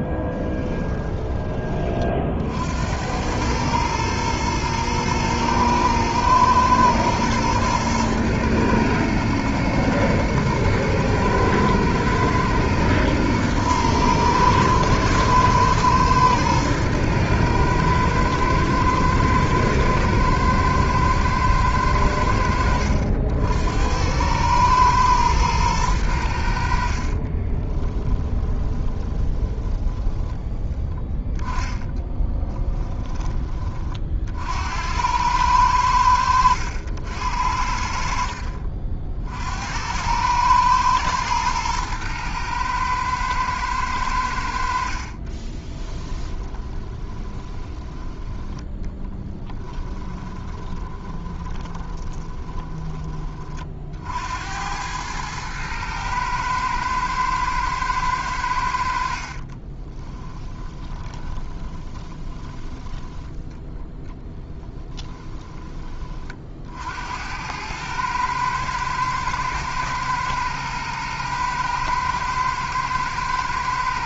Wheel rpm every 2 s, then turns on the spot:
10, 80, 110, 110, 120, 110, 110, 110, 110, 110, 110, 70, 110, 50, 20, 10, 10, 80, 80, 50, 110, 110, 60, 20, 10, 20, 20, 100, 110, 60, 20, 10, 10, 70, 110, 110, 120.
0-2 28-30 44-52 60-62 64-66